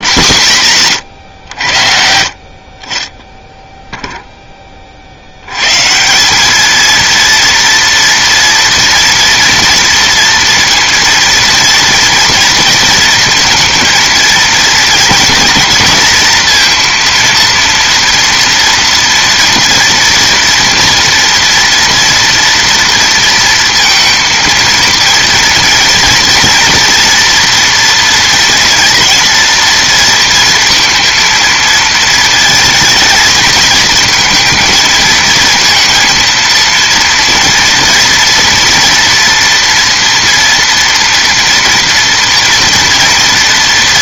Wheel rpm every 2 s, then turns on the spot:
170, 50, 10, 200, 230, 230, 230, 230, 230, 230, 230, 230, 220, 230, 230, 230, 230, 230, 230, 240, 230, 230.
none